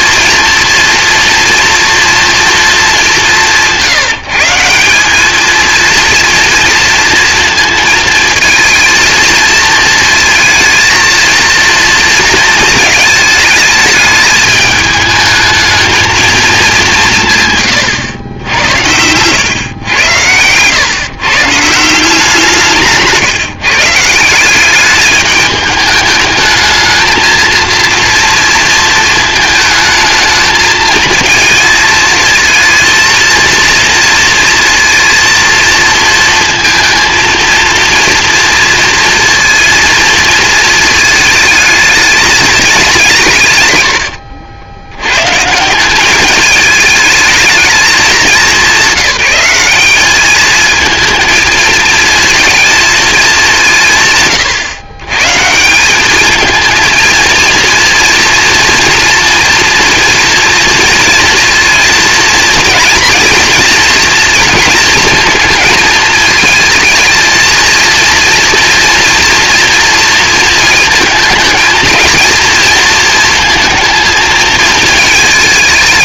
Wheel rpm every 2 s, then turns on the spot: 230, 200, 190, 230, 220, 230, 220, 210, 190, 100, 130, 160, 210, 220, 230, 220, 230, 230, 230, 230, 220, 200, 100, 220, 200, 220, 220, 120, 230, 230, 230, 230, 230, 220, 230, 220, 220, 220.
none